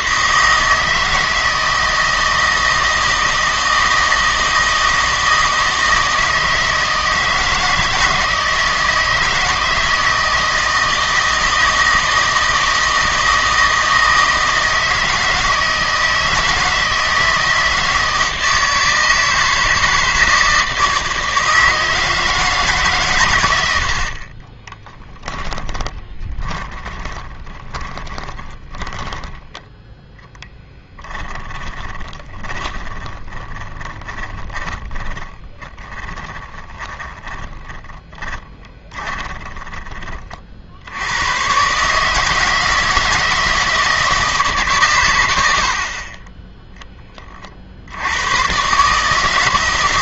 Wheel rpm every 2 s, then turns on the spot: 160, 160, 160, 160, 160, 160, 160, 160, 160, 160, 160, 150, 20, 10, 10, 10, 20, 20, 20, 30, 70, 160, 140, 10, 130.
24-40